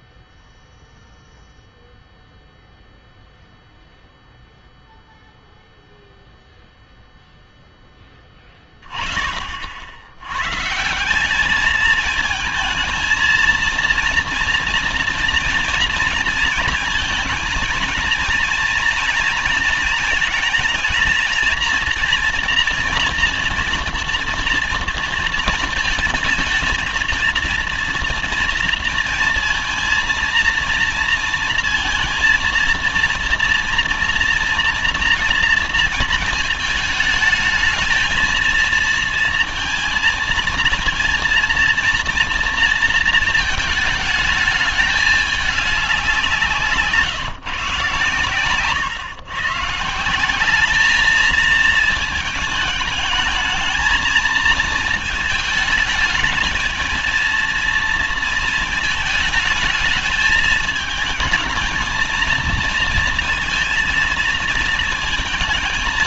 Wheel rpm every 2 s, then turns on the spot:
0, 0, 0, 0, 20, 130, 220, 240, 230, 230, 220, 240, 230, 220, 230, 230, 230, 230, 220, 220, 230, 230, 220, 170, 140, 180, 220, 220, 220, 220, 220, 230, 230.
none